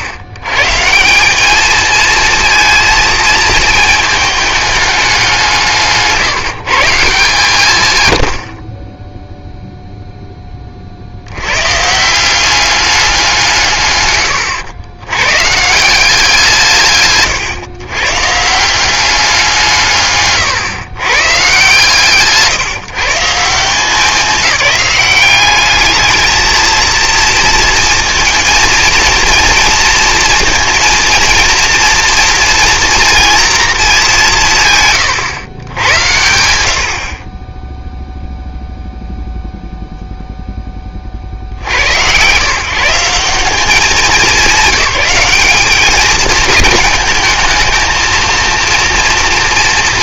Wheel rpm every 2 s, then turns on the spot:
140, 230, 210, 160, 50, 20, 190, 110, 160, 160, 140, 140, 210, 220, 230, 230, 230, 150, 80, 0, 10, 130, 210, 210, 230.
none